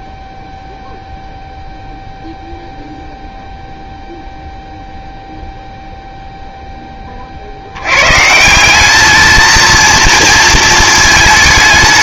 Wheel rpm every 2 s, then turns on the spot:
0, 0, 0, 100, 230, 210.
none